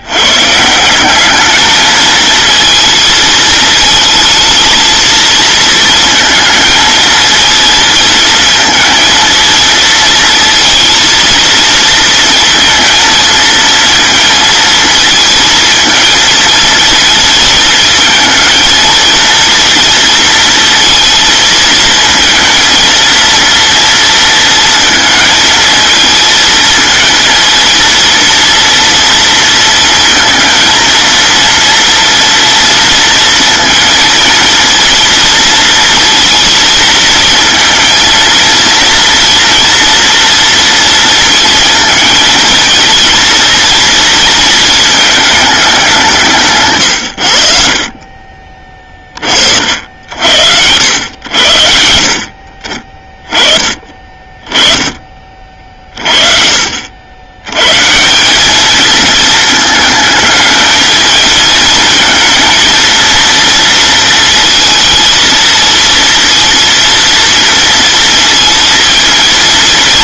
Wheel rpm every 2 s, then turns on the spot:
140, 230, 220, 220, 220, 230, 230, 230, 230, 220, 230, 230, 230, 220, 230, 230, 230, 230, 230, 230, 230, 230, 230, 150, 40, 80, 40, 20, 50, 200, 220, 230, 220, 230, 230.
none